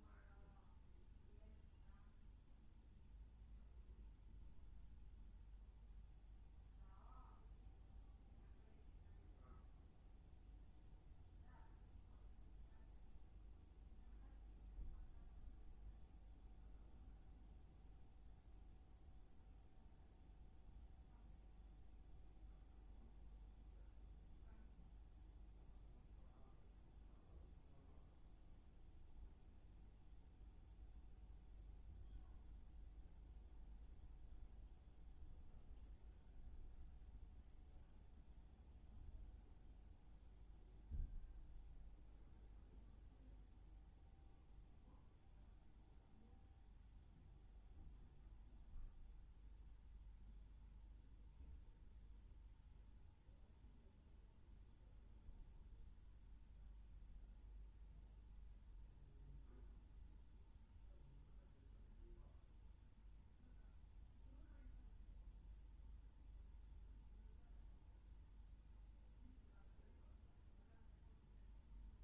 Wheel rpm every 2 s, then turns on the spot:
0, 0, 0, 0, 0, 0, 0, 0, 0, 0, 0, 0, 0, 0, 0, 0, 0, 0, 0, 0, 0, 0, 0, 0, 0, 0, 0, 0, 0, 0, 0, 0, 0, 0, 0, 0.
none